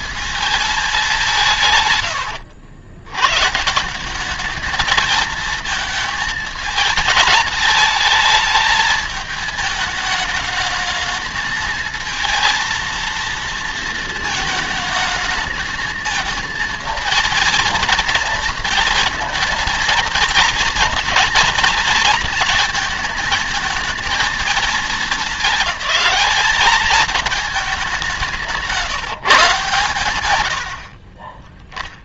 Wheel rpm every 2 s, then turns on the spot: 220, 110, 210, 220, 220, 210, 230, 220, 230, 220, 230, 230, 210, 200, 170, 100.
28-30